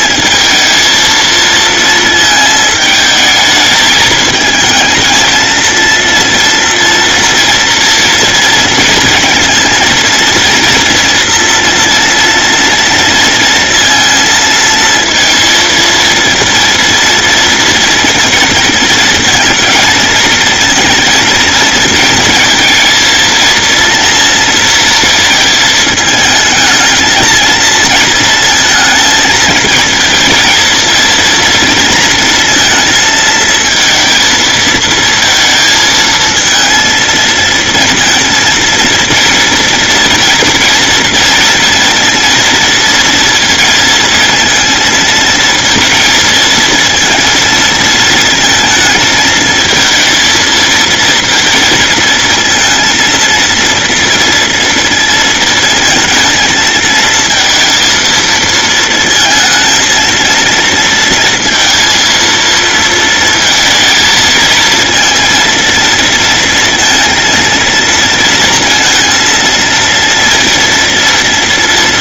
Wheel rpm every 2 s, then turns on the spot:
230, 220, 220, 230, 230, 240, 230, 230, 230, 230, 230, 220, 230, 220, 220, 220, 230, 220, 220, 230, 230, 230, 230, 230, 220, 230, 230, 230, 220, 230, 230, 230, 230, 230, 230, 230.
none